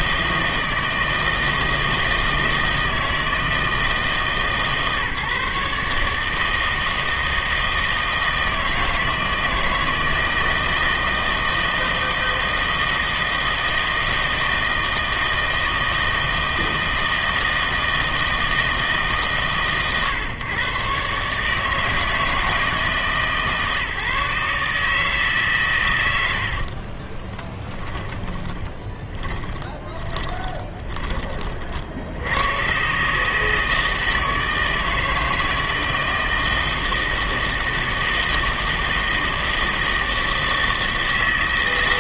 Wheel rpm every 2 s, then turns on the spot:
160, 160, 150, 160, 160, 160, 160, 160, 160, 160, 120, 160, 150, 50, 20, 10, 120, 160, 160, 160, 160.
26-32